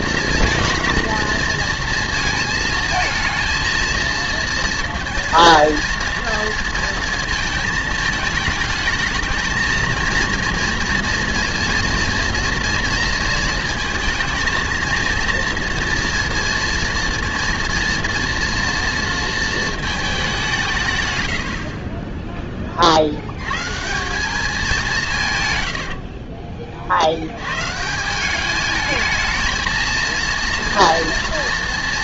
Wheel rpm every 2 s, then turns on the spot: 230, 230, 230, 230, 220, 230, 230, 230, 230, 230, 160, 30, 180, 50, 220, 230.
none